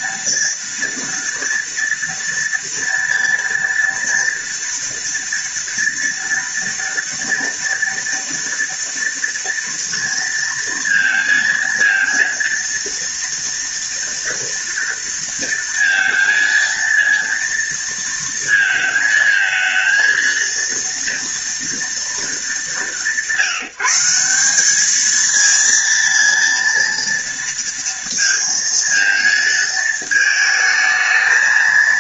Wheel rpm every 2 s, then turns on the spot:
230, 230, 230, 230, 230, 220, 230, 230, 230, 220, 230, 170, 220, 230, 220, 220.
none